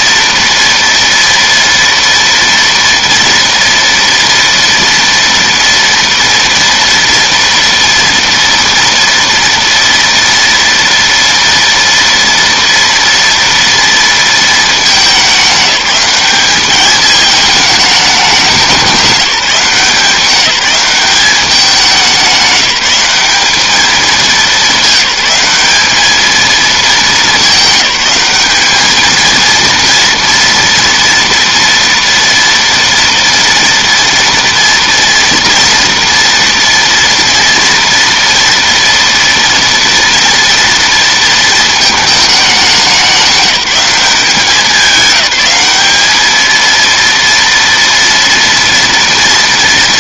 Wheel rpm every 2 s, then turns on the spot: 230, 230, 230, 230, 230, 230, 230, 210, 210, 200, 200, 200, 200, 220, 220, 230, 230, 230, 230, 230, 230, 190, 200, 230, 230.
none